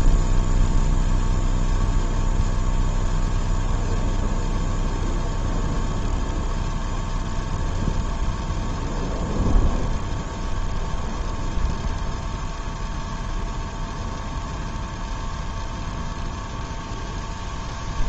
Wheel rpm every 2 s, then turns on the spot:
0, 0, 0, 0, 0, 0, 0, 0, 0.
none